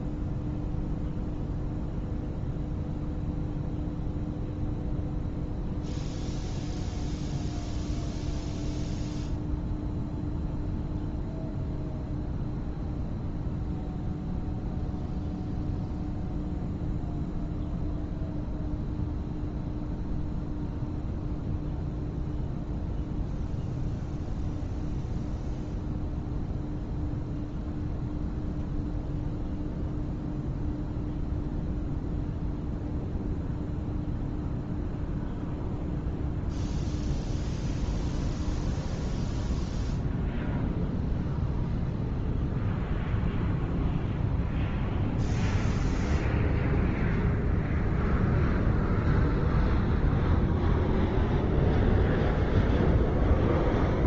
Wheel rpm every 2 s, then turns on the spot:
0, 0, 0, 0, 0, 0, 0, 0, 0, 0, 0, 0, 0, 0, 0, 0, 0, 0, 0, 0, 0, 0, 0, 0, 0, 0, 0.
none